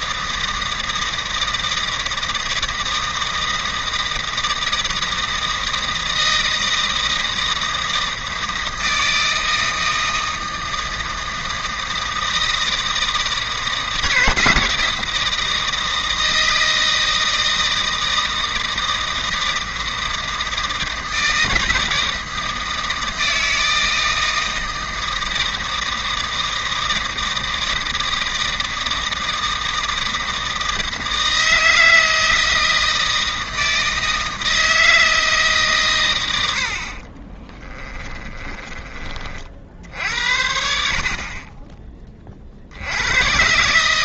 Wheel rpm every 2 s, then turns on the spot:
160, 160, 160, 160, 160, 160, 160, 160, 160, 160, 160, 160, 160, 160, 160, 160, 160, 160, 30, 40, 40, 100.
36-38